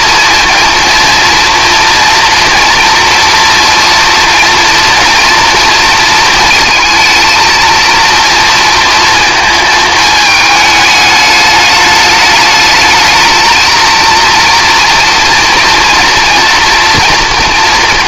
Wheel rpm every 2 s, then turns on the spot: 230, 230, 240, 220, 230, 210, 220, 230, 230.
none